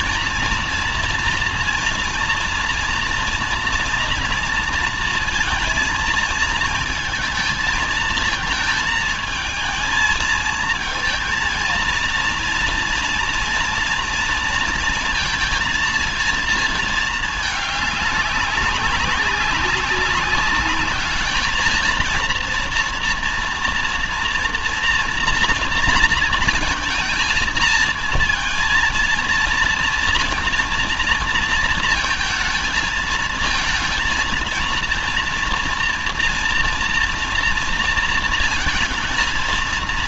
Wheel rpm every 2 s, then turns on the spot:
230, 230, 230, 220, 220, 220, 230, 230, 210, 190, 200, 230, 240, 230, 230, 230, 220, 230, 230, 220.
none